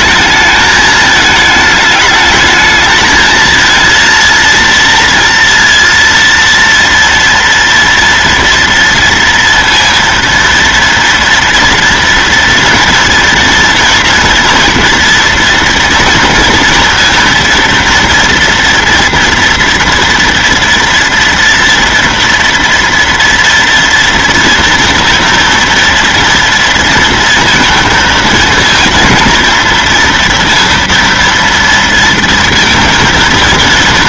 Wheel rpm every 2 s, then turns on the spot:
220, 220, 230, 230, 230, 230, 230, 230, 230, 240, 240, 230, 230, 230, 230, 230, 230.
none